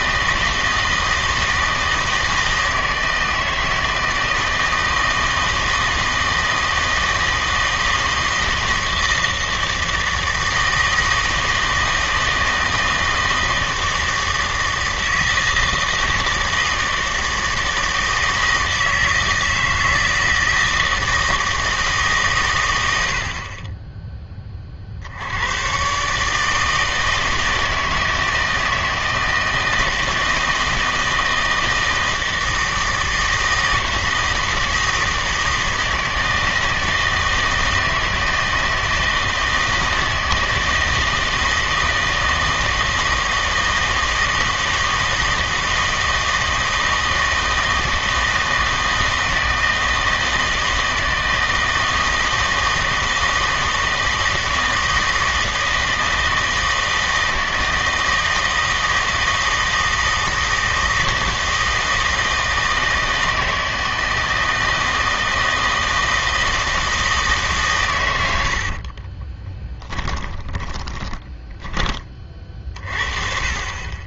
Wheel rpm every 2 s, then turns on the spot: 170, 160, 160, 160, 160, 160, 160, 160, 160, 160, 160, 100, 40, 160, 160, 160, 160, 160, 160, 160, 160, 160, 160, 160, 160, 160, 160, 160, 160, 160, 160, 160, 160, 160, 60, 20, 40.
68-72